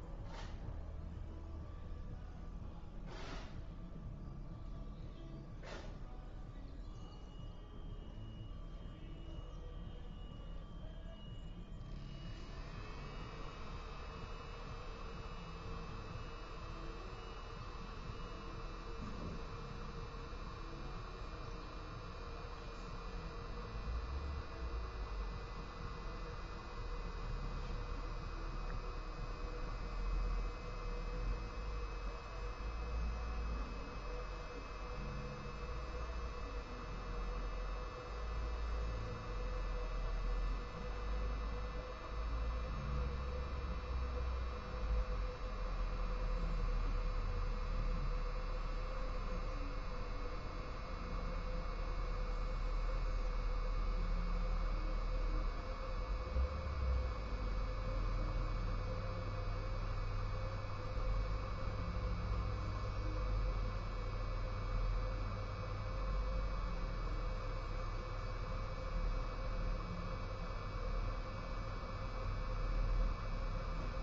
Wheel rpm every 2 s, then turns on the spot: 0, 0, 0, 0, 0, 0, 0, 0, 0, 0, 0, 0, 0, 0, 0, 0, 0, 0, 0, 0, 0, 0, 0, 0, 0, 0, 0, 0, 0, 0, 0, 0, 0, 0, 0, 0, 0.
none